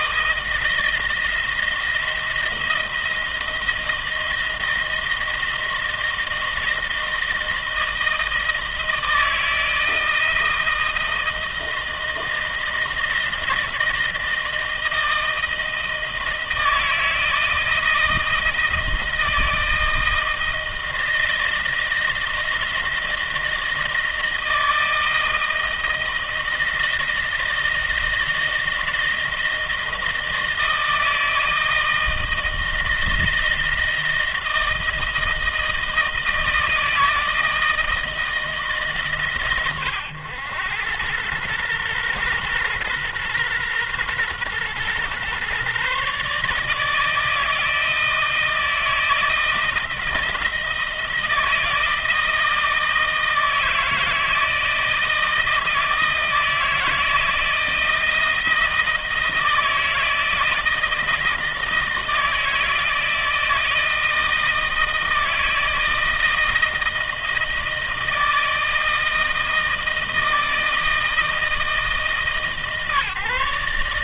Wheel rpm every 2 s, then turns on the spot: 170, 160, 160, 160, 160, 160, 160, 160, 160, 160, 160, 160, 160, 160, 160, 160, 160, 160, 160, 160, 100, 120, 120, 150, 160, 160, 160, 160, 160, 160, 160, 160, 160, 160, 160, 160, 150.
none